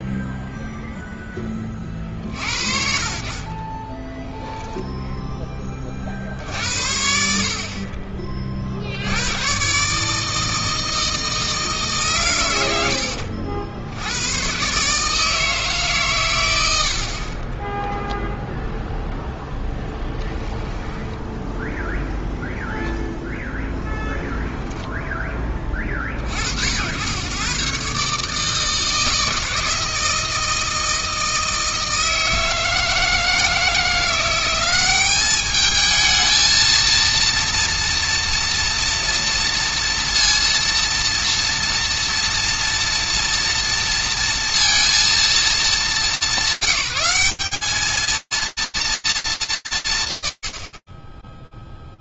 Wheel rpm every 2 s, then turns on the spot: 0, 50, 0, 70, 70, 160, 80, 140, 60, 0, 10, 0, 10, 80, 160, 160, 160, 200, 230, 230, 230, 230, 230, 200, 230, 30.
12-14 16-18 20-22